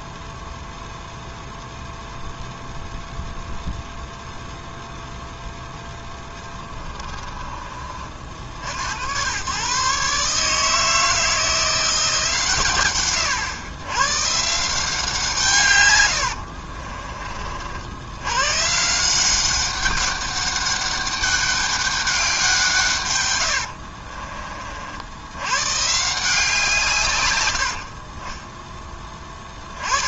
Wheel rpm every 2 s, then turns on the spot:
0, 0, 0, 20, 90, 160, 130, 160, 40, 160, 200, 140, 60, 140, 10.
6-8 16-18